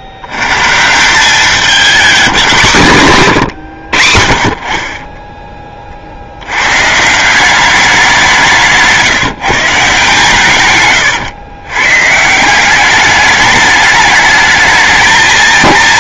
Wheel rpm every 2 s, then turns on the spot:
80, 180, 50, 100, 170, 130, 180, 220.
none